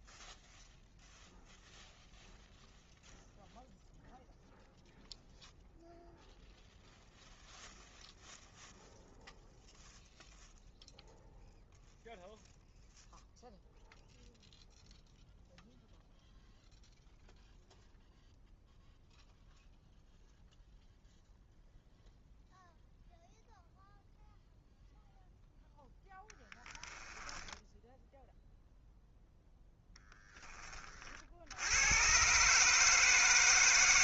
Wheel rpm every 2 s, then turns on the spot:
0, 0, 0, 0, 0, 0, 0, 0, 0, 0, 0, 0, 0, 10, 0, 30, 150.
26-28